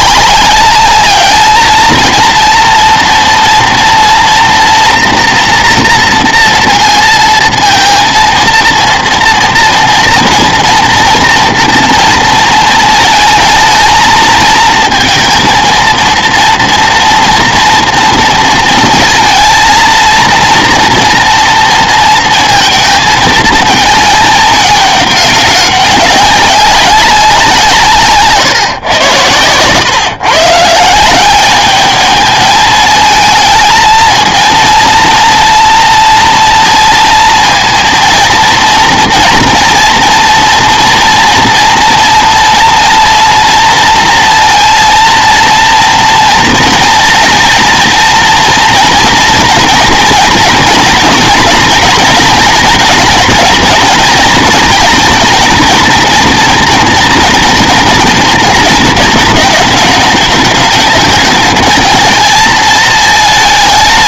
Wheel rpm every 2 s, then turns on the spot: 200, 240, 230, 230, 230, 230, 220, 230, 240, 230, 230, 230, 210, 190, 120, 160, 220, 230, 230, 230, 230, 230, 230, 230, 220, 220, 230, 220, 230, 220, 210, 220.
none